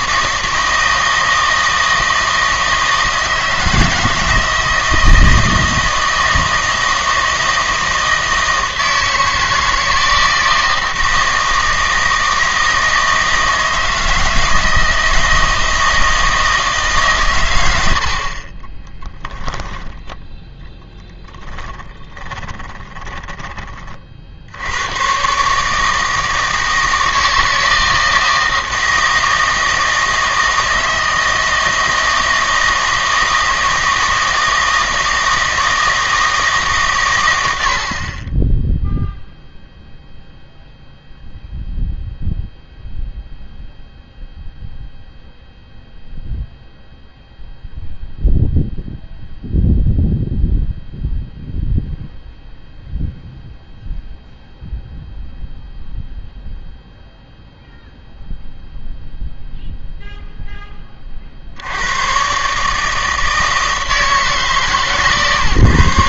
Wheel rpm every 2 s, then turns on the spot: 160, 160, 160, 160, 160, 160, 160, 160, 160, 40, 10, 10, 80, 160, 160, 160, 160, 160, 150, 10, 0, 0, 0, 0, 0, 0, 0, 0, 0, 0, 10, 140, 140.
18-20 22-24